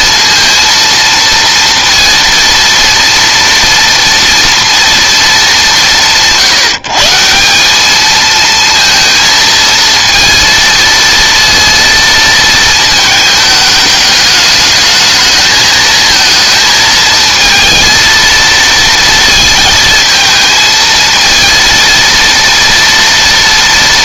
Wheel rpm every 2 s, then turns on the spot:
230, 230, 230, 160, 230, 230, 220, 220, 220, 230, 220, 230.
none